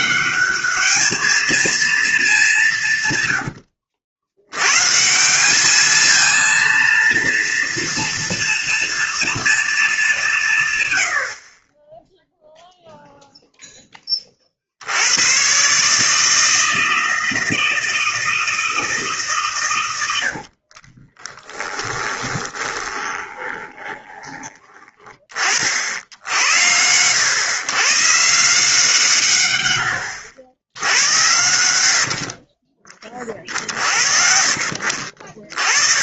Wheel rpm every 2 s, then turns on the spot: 220, 110, 170, 230, 230, 80, 0, 100, 160, 150, 20, 20, 20, 100, 150, 80, 30, 50.
20-24